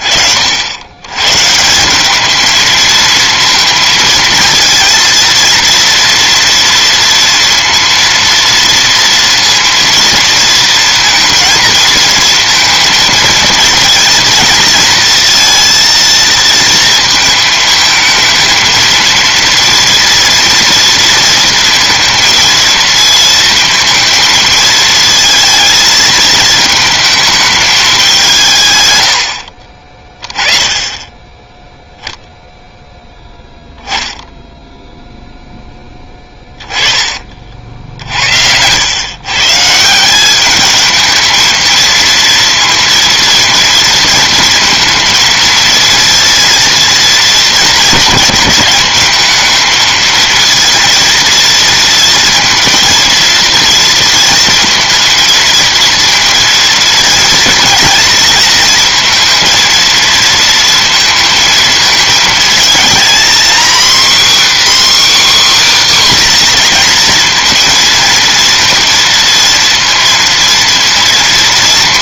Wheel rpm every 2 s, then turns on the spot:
40, 210, 230, 230, 230, 220, 230, 230, 230, 230, 230, 230, 220, 220, 180, 20, 0, 0, 20, 120, 220, 230, 230, 230, 210, 230, 230, 230, 230, 230, 230, 230, 280, 240, 230, 230.
none